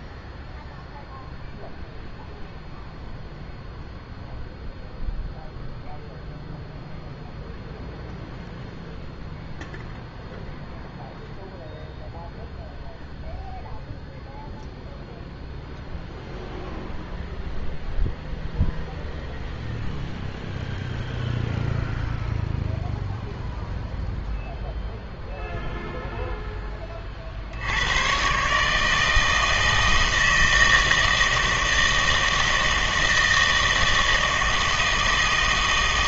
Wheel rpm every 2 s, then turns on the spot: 0, 0, 0, 0, 0, 0, 0, 0, 0, 0, 0, 0, 0, 20, 150, 160, 160, 160.
none